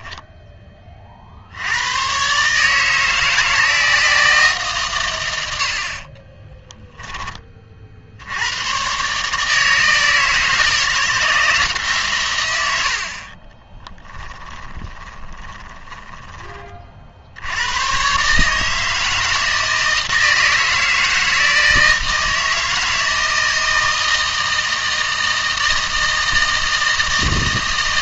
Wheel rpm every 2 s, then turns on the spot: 20, 150, 150, 10, 110, 160, 100, 10, 40, 150, 160, 160, 160, 160.
14-16